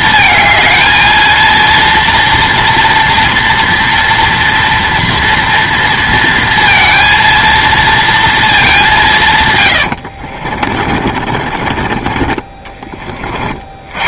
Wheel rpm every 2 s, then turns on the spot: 220, 230, 230, 230, 210, 40, 20.
10-12